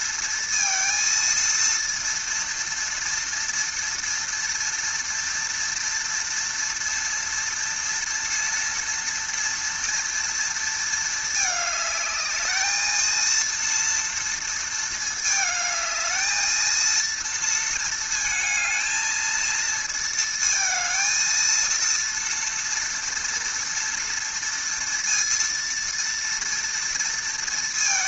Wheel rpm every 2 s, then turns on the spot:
230, 230, 230, 230, 230, 230, 220, 230, 220, 220, 230, 230, 230, 230.
none